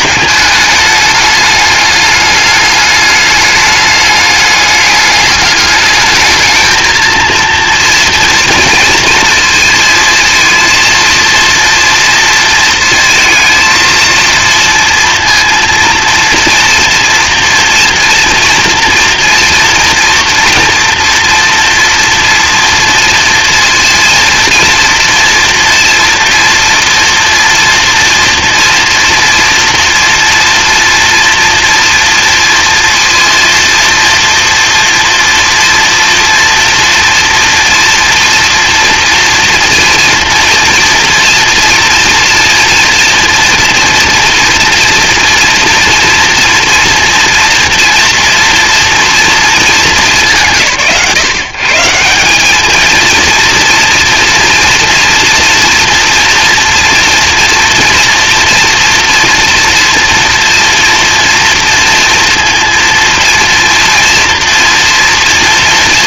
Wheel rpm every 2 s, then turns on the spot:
210, 210, 210, 220, 240, 230, 230, 230, 230, 230, 230, 230, 230, 230, 230, 230, 230, 230, 230, 240, 230, 240, 230, 230, 230, 150, 200, 240, 240, 230, 230, 230, 230.
none